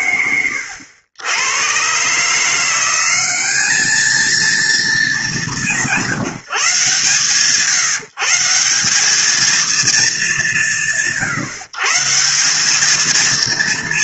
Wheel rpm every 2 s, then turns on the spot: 90, 200, 200, 160, 210, 130, 220.
none